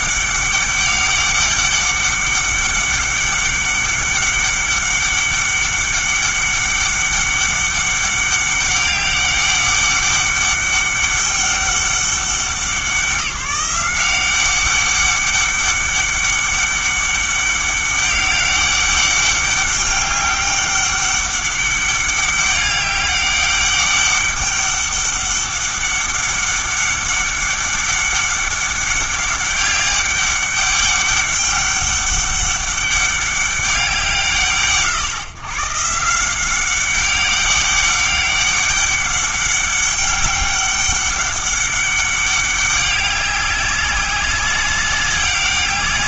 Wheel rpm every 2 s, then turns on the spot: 200, 200, 200, 200, 200, 200, 180, 190, 200, 200, 200, 200, 200, 200, 200, 200, 200, 150, 190, 200, 200, 200, 200.
none